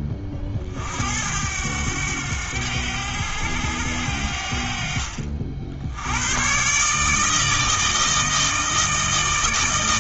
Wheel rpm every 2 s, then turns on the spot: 50, 90, 60, 140, 160.
none